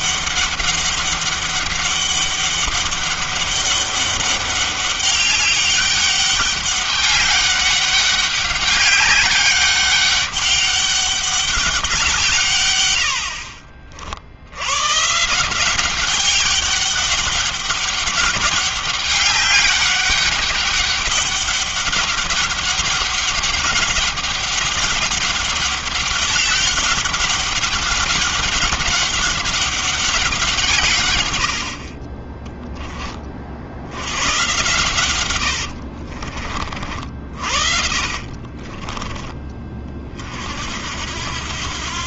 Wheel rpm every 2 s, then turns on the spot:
200, 200, 200, 200, 200, 200, 140, 60, 200, 200, 200, 200, 190, 200, 200, 180, 30, 110, 50, 30, 50.
36-40